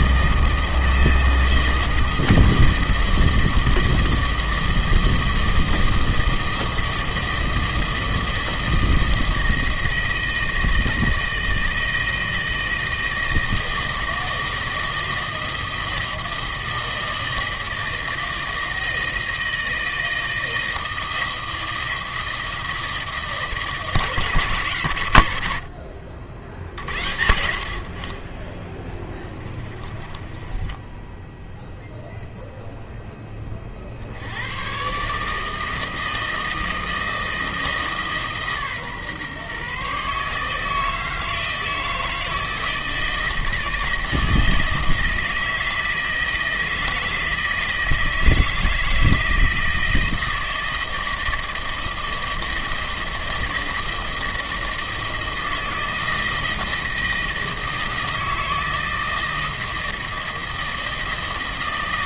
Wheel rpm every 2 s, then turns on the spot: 160, 160, 160, 160, 160, 160, 160, 160, 160, 160, 160, 160, 120, 60, 10, 10, 0, 120, 160, 140, 160, 160, 160, 160, 160, 160, 160, 160, 160, 160, 160.
28-32